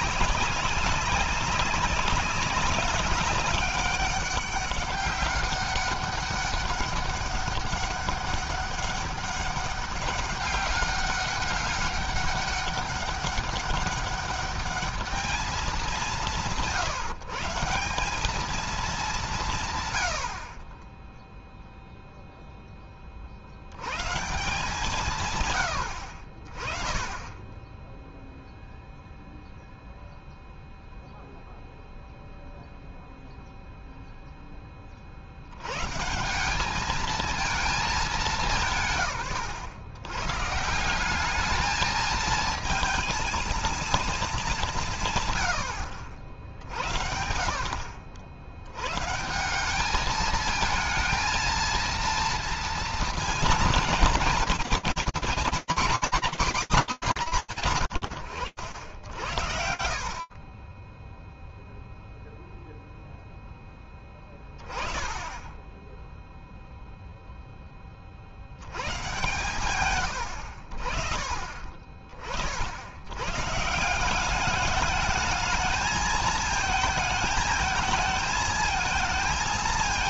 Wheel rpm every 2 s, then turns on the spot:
180, 200, 200, 200, 200, 200, 200, 200, 180, 200, 70, 0, 150, 50, 0, 0, 0, 0, 180, 190, 130, 220, 210, 70, 70, 220, 230, 230, 190, 80, 0, 0, 10, 10, 130, 40, 150, 220, 220, 220.
none